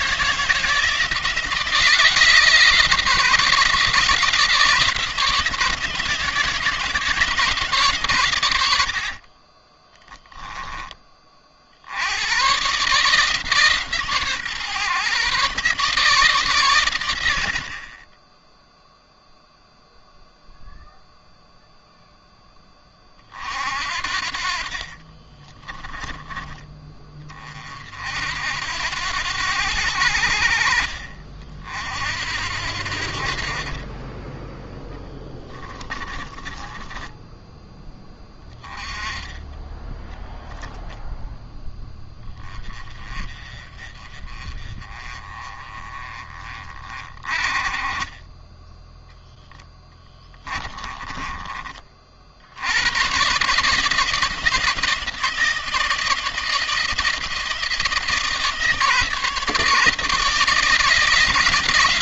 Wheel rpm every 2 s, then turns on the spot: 170, 160, 160, 160, 70, 20, 140, 140, 100, 0, 0, 20, 50, 30, 80, 60, 70, 30, 20, 20, 10, 30, 30, 20, 0, 20, 90, 170, 170, 160, 170.
8-10 24-26 34-36 50-52